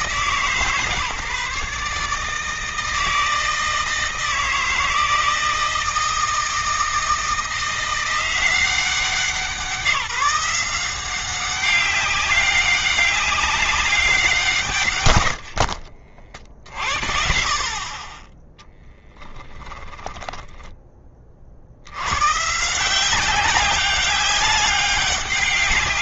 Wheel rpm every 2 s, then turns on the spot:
160, 150, 160, 160, 180, 180, 200, 160, 60, 10, 10, 130, 200.
20-22